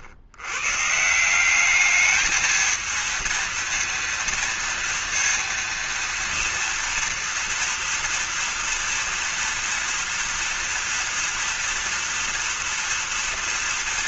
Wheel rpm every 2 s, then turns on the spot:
120, 220, 230, 230, 230, 230, 230.
none